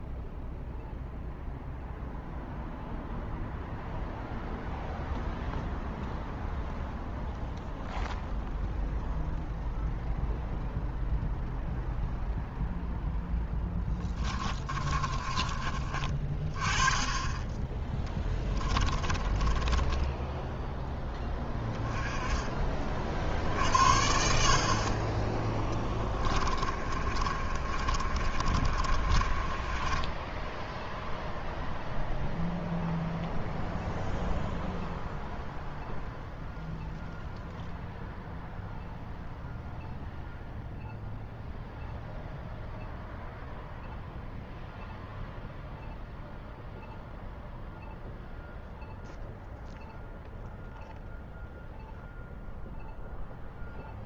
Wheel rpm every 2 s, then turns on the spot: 0, 0, 0, 0, 0, 0, 0, 20, 30, 20, 10, 30, 50, 20, 30, 0, 0, 0, 0, 0, 0, 0, 0, 0, 0, 0, 0.
14-16 18-22 26-30